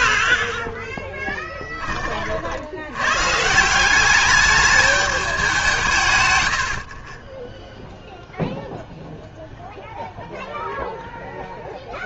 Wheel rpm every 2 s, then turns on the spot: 10, 70, 210, 80, 0, 0.
none